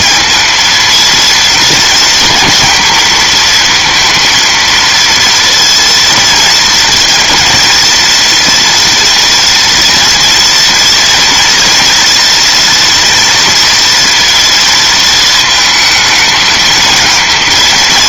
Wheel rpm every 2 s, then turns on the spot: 230, 230, 230, 230, 230, 240, 230, 230, 220.
none